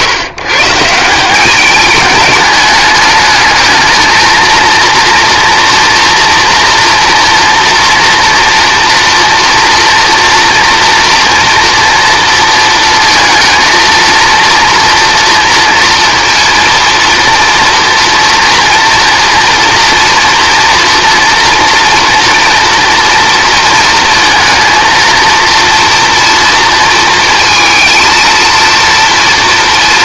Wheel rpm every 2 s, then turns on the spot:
140, 210, 230, 240, 230, 230, 230, 230, 230, 240, 230, 230, 230, 230, 230.
none